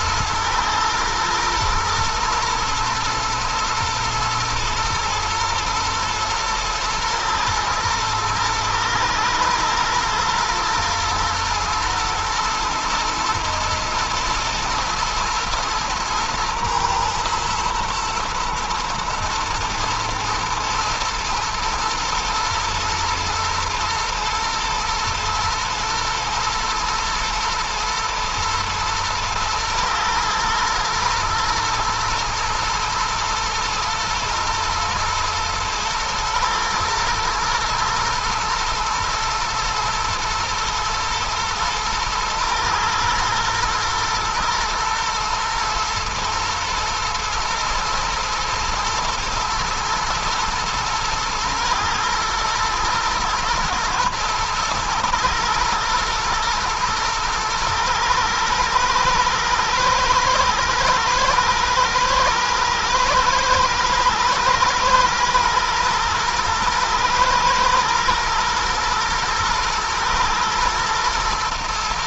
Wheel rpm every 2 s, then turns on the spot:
110, 110, 110, 120, 110, 120, 110, 110, 110, 120, 110, 120, 120, 120, 120, 120, 120, 110, 110, 110, 110, 110, 120, 120, 110, 110, 110, 110, 110, 110, 120, 110, 120, 110, 110, 110.
none